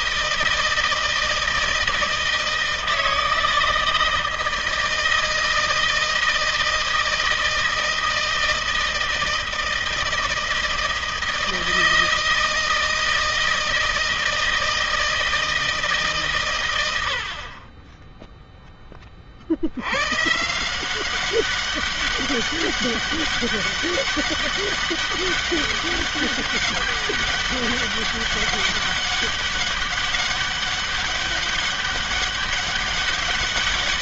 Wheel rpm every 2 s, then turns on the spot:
160, 160, 160, 160, 160, 160, 160, 160, 110, 10, 160, 200, 200, 200, 200, 200, 200.
none